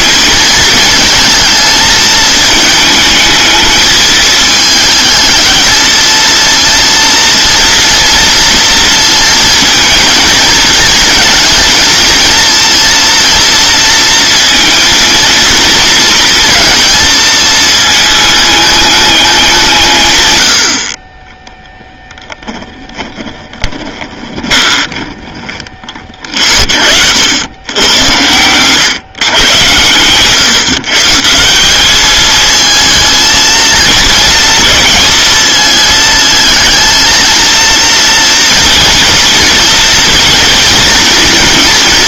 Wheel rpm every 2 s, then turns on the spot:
220, 220, 210, 230, 230, 220, 230, 230, 230, 210, 70, 20, 30, 50, 120, 150, 230, 220, 220, 230, 230.
22-26